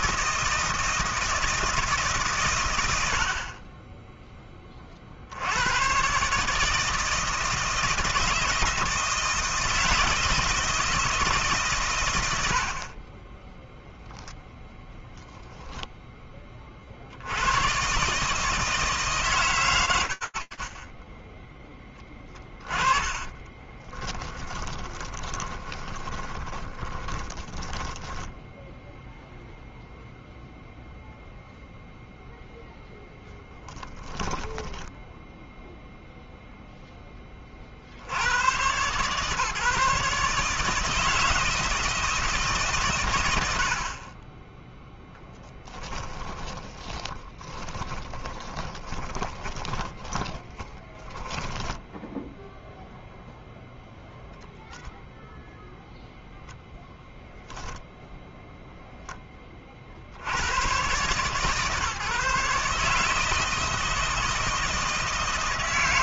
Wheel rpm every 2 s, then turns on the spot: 160, 130, 20, 140, 160, 160, 110, 0, 20, 150, 30, 10, 10, 10, 0, 0, 0, 10, 0, 120, 150, 120, 0, 10, 20, 10, 0, 20, 0, 0, 110, 150, 160.
22-28 46-52